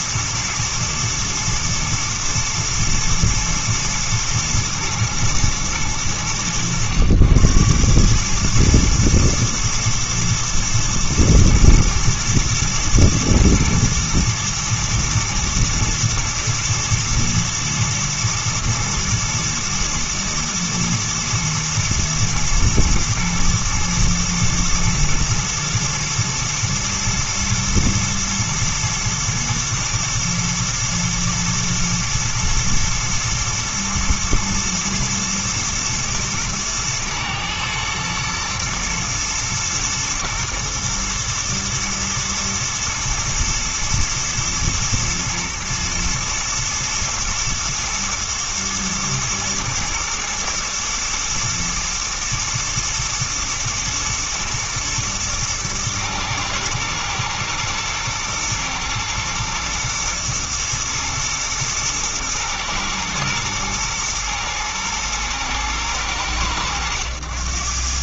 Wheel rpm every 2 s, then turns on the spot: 120, 110, 110, 80, 110, 120, 110, 110, 110, 120, 110, 120, 110, 110, 120, 110, 120, 120, 120, 120, 110, 110, 110, 110, 120, 120, 120, 110, 120, 110, 110, 120, 120, 90.
none